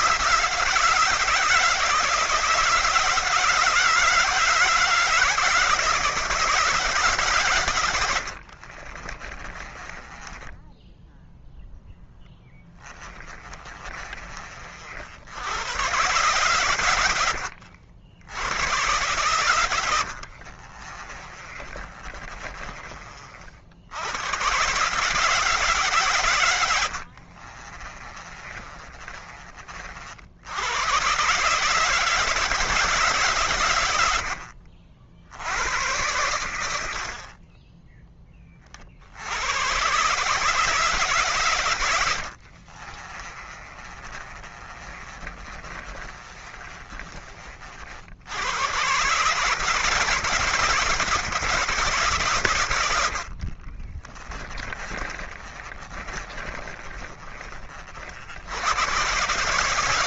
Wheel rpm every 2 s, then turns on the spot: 160, 170, 170, 160, 60, 10, 10, 40, 120, 100, 50, 30, 120, 100, 30, 90, 150, 60, 90, 30, 140, 50, 30, 30, 90, 160, 100, 20, 30, 100.
8-14 20-24 26-30 34-36 42-48 52-58